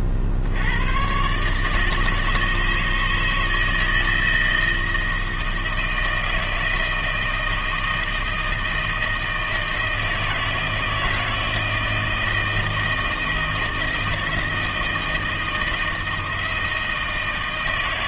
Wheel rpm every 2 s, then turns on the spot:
80, 150, 160, 160, 160, 160, 160, 160, 160.
none